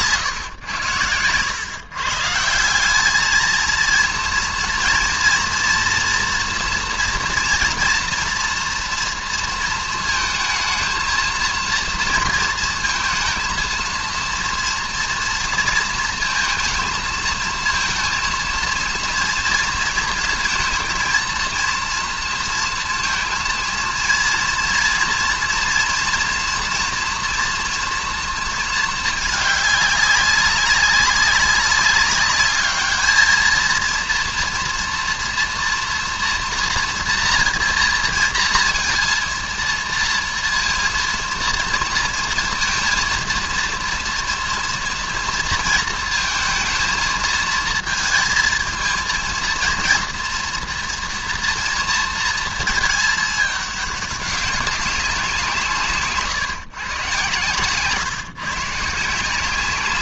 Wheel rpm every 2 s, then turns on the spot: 110, 180, 230, 240, 240, 220, 220, 230, 230, 230, 230, 230, 230, 230, 230, 200, 210, 230, 230, 230, 230, 230, 230, 230, 220, 230, 220, 200, 140, 140.
none